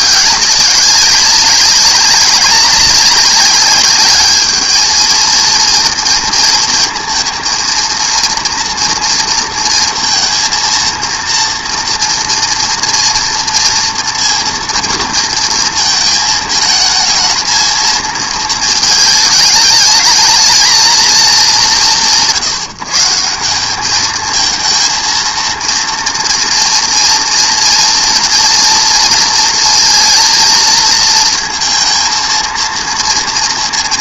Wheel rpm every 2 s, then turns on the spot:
200, 190, 220, 230, 230, 230, 230, 230, 220, 220, 220, 160, 220, 230, 230, 230, 230.
none